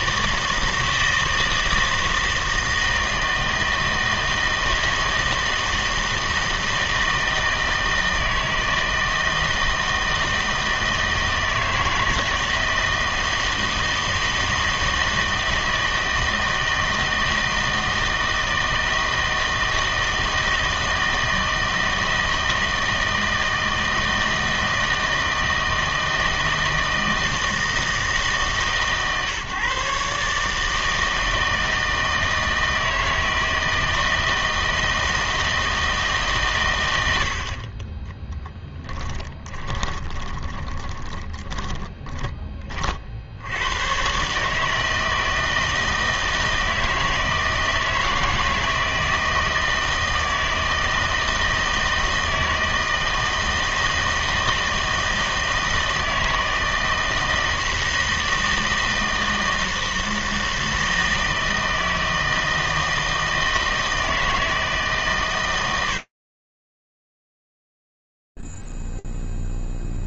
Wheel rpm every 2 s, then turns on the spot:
160, 160, 160, 160, 160, 160, 160, 160, 160, 160, 160, 160, 160, 160, 150, 160, 160, 160, 100, 10, 20, 30, 160, 160, 160, 160, 160, 160, 160, 160, 160, 160, 150, 10, 0.
38-42